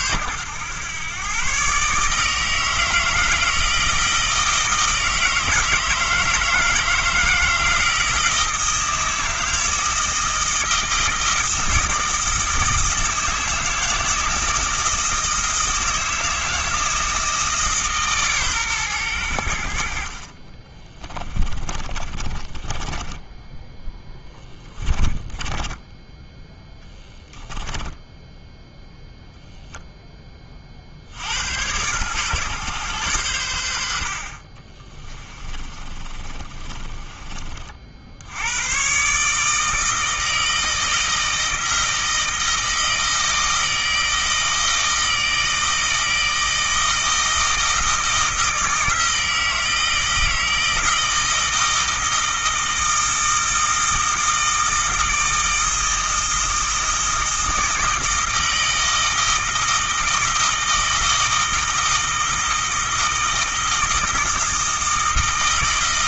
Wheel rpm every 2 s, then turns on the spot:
120, 160, 160, 160, 160, 160, 160, 160, 160, 110, 20, 20, 20, 10, 0, 50, 120, 30, 30, 130, 160, 160, 160, 160, 160, 160, 160, 160, 160, 160, 160, 160, 160.
20-28 34-38